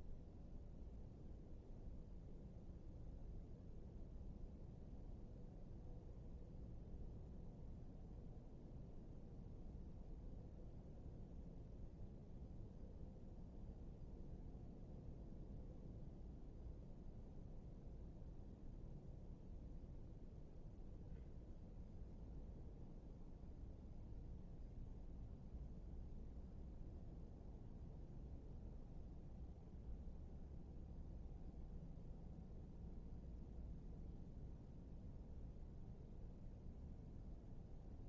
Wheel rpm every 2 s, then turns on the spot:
0, 0, 0, 0, 0, 0, 0, 0, 0, 0, 0, 0, 0, 0, 0, 0, 0, 0, 0.
none